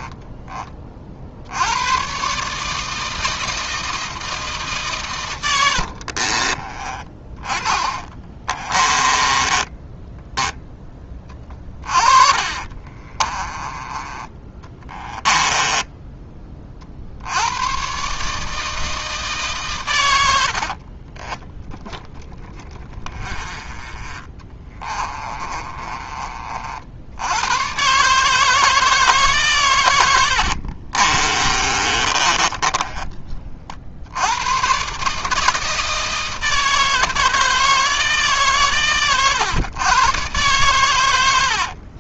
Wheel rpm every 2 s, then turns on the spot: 30, 150, 130, 30, 20, 10, 30, 20, 50, 160, 40, 30, 20, 70, 160, 50, 20, 130, 160, 130, 100.
6-10 12-16 20-26 30-34